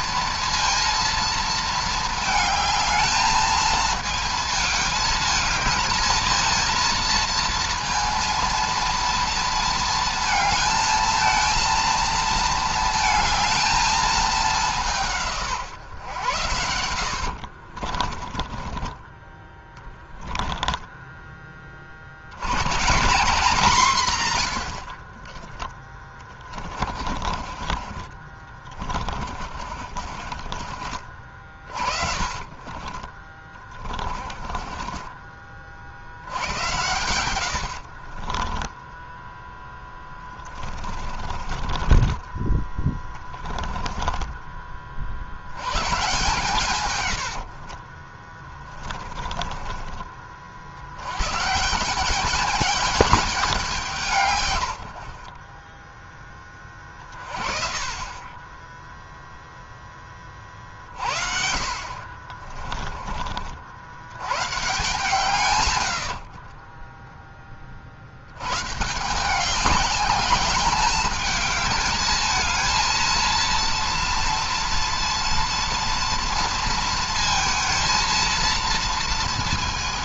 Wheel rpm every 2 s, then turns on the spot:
230, 220, 220, 230, 230, 220, 220, 180, 80, 20, 10, 150, 60, 30, 30, 40, 30, 30, 100, 10, 30, 20, 30, 110, 20, 80, 210, 80, 30, 0, 50, 30, 140, 20, 140, 210, 230, 230, 230, 230.
16-20 24-42 46-50 62-64 66-68